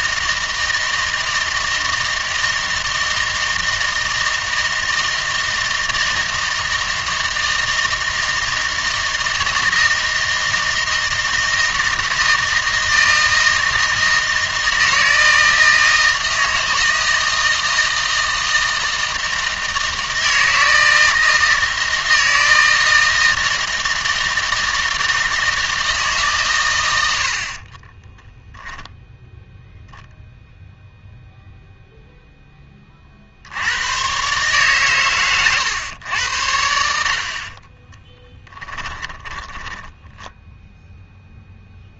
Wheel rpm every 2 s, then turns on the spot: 160, 160, 160, 160, 160, 160, 160, 160, 160, 160, 160, 160, 160, 140, 10, 0, 20, 130, 70, 20, 0.
38-40